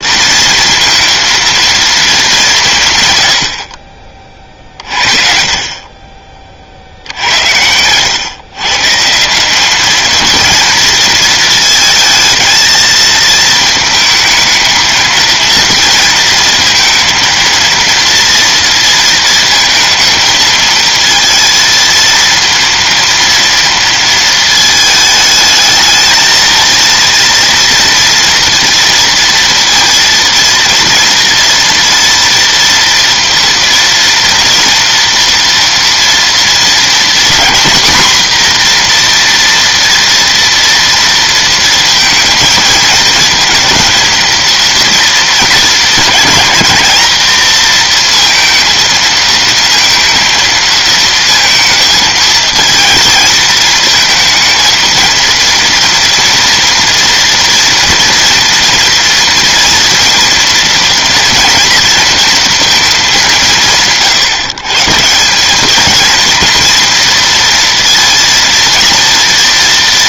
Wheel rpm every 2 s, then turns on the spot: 230, 190, 40, 50, 140, 220, 220, 220, 230, 230, 220, 230, 220, 230, 230, 230, 230, 230, 230, 240, 230, 230, 230, 220, 230, 230, 220, 220, 230, 230, 230, 230, 140, 230, 230.
none